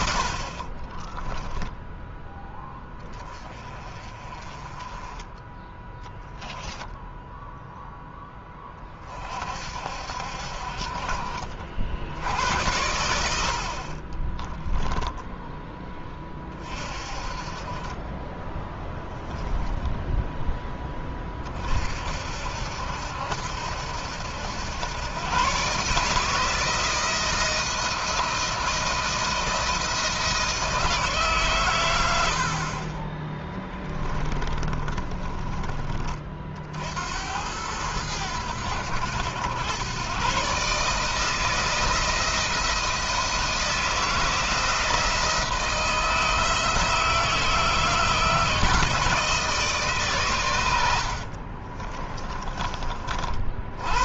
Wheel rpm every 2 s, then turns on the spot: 40, 20, 20, 0, 20, 50, 80, 10, 30, 10, 10, 70, 90, 160, 170, 160, 30, 20, 70, 90, 150, 170, 170, 160, 160, 100, 30.
0-2 14-16 18-20 32-36 50-54